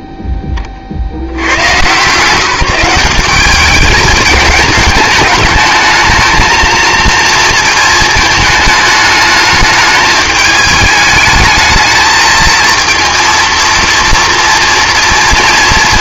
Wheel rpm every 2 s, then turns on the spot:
20, 180, 220, 220, 220, 210, 230, 230.
none